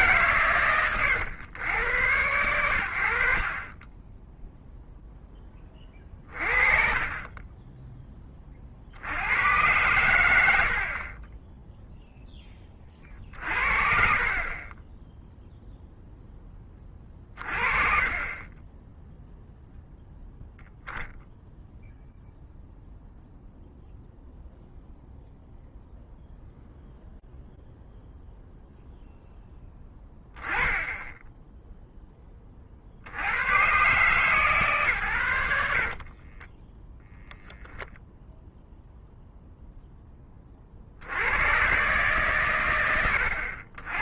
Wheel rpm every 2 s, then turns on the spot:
80, 0, 30, 40, 60, 30, 10, 20, 10, 0, 0, 0, 0, 0, 10, 20, 140, 20, 0, 10, 120, 90.
8-10 12-14 34-36